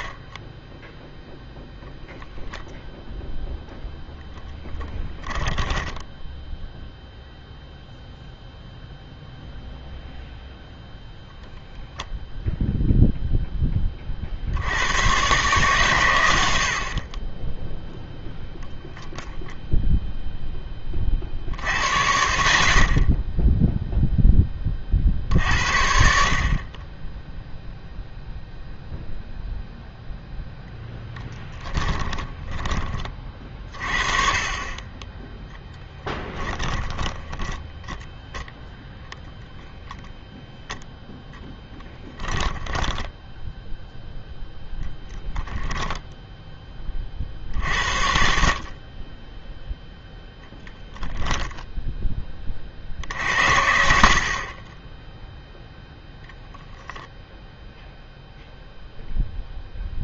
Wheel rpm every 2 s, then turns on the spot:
10, 0, 10, 0, 0, 0, 0, 70, 80, 10, 10, 50, 20, 40, 0, 0, 20, 30, 10, 0, 0, 10, 0, 10, 40, 10, 50, 20, 0, 0.
36-38 42-44 50-52